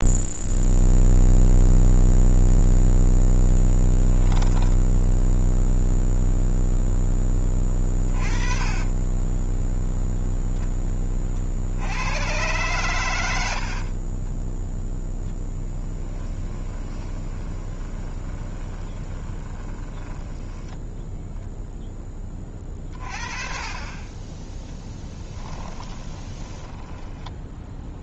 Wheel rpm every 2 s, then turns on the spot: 0, 0, 10, 0, 20, 10, 120, 0, 10, 20, 20, 30, 10, 10.
4-6 8-10 16-20 26-28